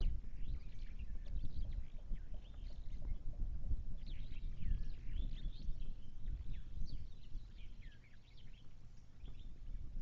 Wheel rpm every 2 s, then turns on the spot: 0, 0, 0, 0, 0.
none